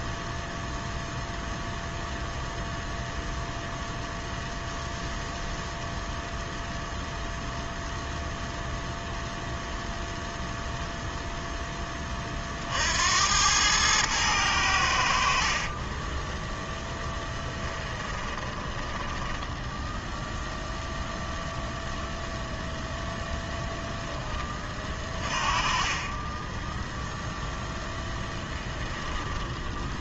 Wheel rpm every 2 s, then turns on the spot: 0, 0, 0, 0, 0, 0, 40, 90, 10, 20, 0, 0, 20, 10, 10.
18-20 28-30